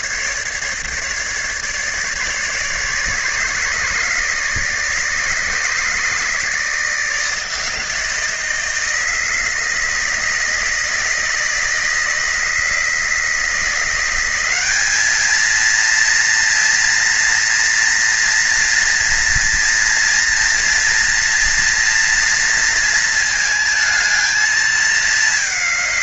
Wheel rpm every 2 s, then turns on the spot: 150, 150, 150, 150, 160, 160, 160, 170, 230, 230, 230, 230, 220.
none